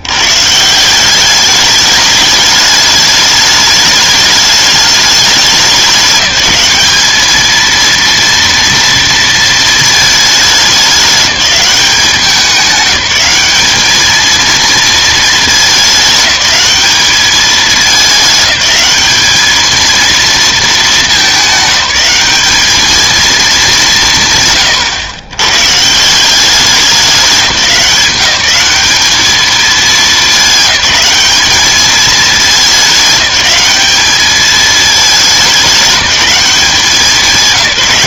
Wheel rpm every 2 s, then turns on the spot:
150, 210, 210, 200, 230, 210, 190, 230, 210, 210, 220, 210, 130, 190, 200, 210, 210, 210, 200.
none